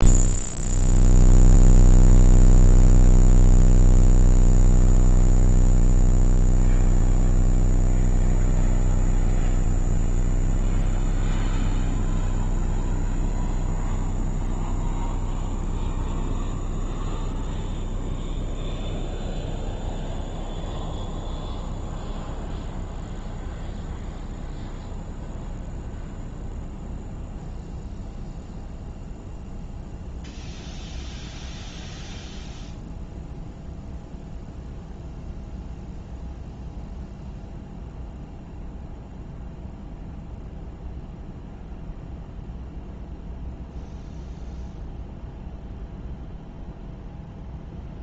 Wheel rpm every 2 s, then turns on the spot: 0, 0, 0, 0, 0, 0, 0, 0, 0, 0, 0, 0, 0, 0, 0, 0, 0, 0, 0, 0, 0, 0, 0, 0.
none